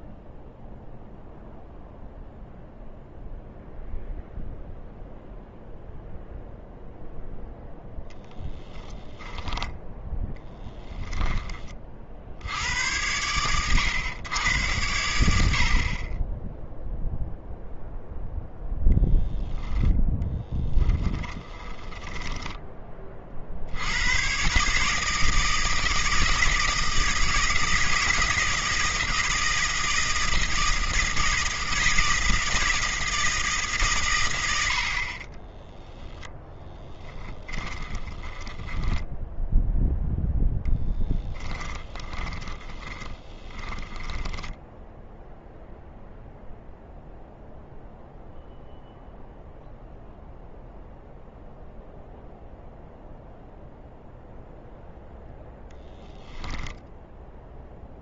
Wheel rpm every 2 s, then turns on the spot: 0, 0, 0, 0, 20, 10, 90, 100, 0, 0, 10, 20, 150, 160, 160, 160, 160, 70, 10, 10, 0, 20, 0, 0, 0, 0, 0, 0, 10.
20-22 38-40 42-44